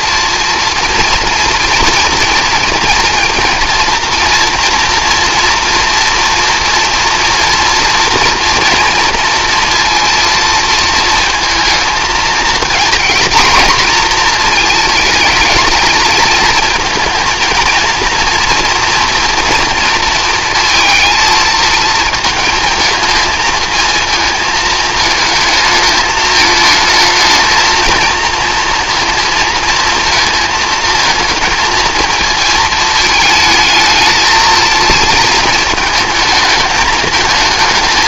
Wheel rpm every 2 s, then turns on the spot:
230, 230, 230, 230, 230, 230, 230, 230, 230, 240, 230, 220, 220, 220, 230, 230, 220, 230, 210.
none